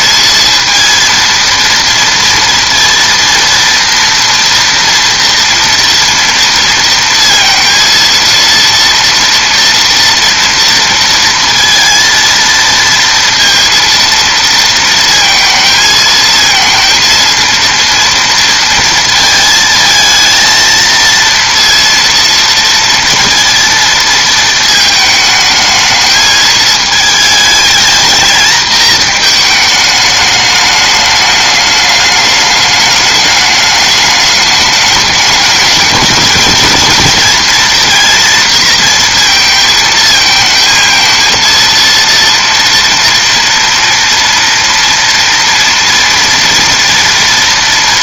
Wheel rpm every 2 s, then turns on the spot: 230, 230, 230, 230, 230, 230, 230, 230, 230, 230, 230, 230, 220, 220, 220, 210, 200, 210, 220, 230, 220, 230, 230, 230.
none